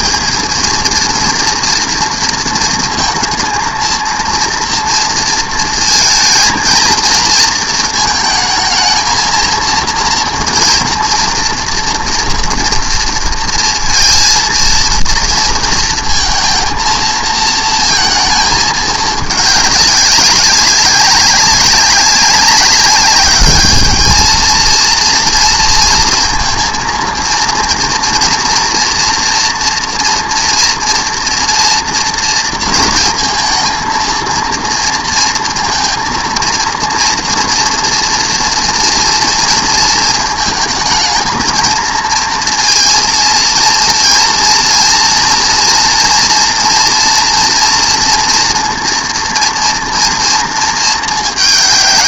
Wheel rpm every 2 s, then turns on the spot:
230, 220, 230, 230, 230, 230, 230, 230, 230, 210, 190, 200, 230, 240, 230, 230, 230, 230, 230, 230, 220, 230, 230, 230, 230, 210.
none